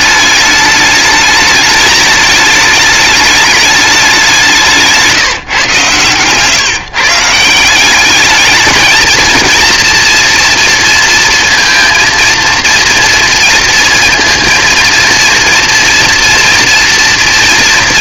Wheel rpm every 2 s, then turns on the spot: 210, 210, 180, 140, 220, 230, 230, 230, 240.
none